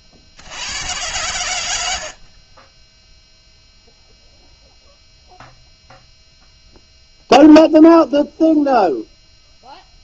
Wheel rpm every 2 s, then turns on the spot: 100, 10, 0, 0, 0.
none